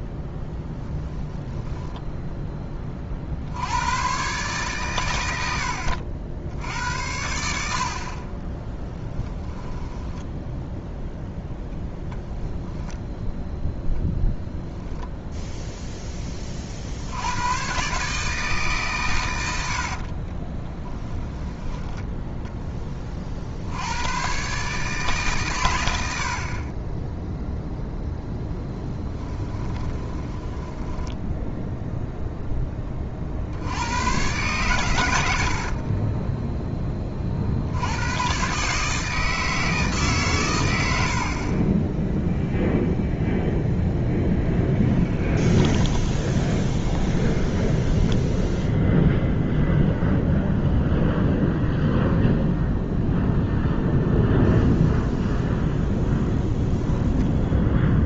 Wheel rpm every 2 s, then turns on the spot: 10, 20, 130, 70, 10, 0, 10, 0, 60, 140, 10, 10, 140, 30, 10, 10, 20, 110, 10, 150, 90, 0, 10, 20, 0, 0, 0, 0, 10.
8-10 20-22 28-32 44-48